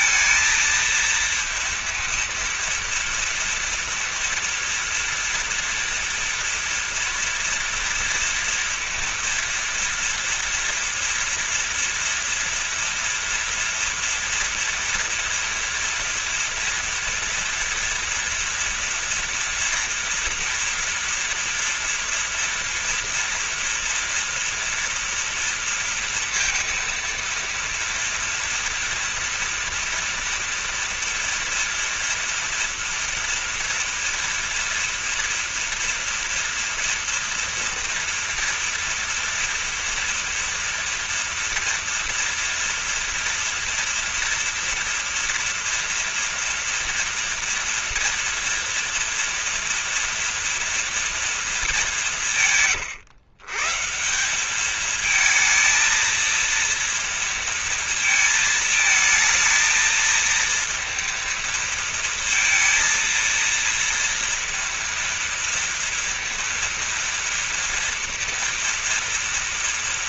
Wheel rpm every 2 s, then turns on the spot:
230, 230, 230, 230, 230, 230, 230, 240, 230, 230, 230, 230, 240, 230, 230, 230, 230, 230, 230, 230, 230, 230, 240, 230, 230, 230, 150, 210, 230, 220, 230, 230, 230, 230, 230.
none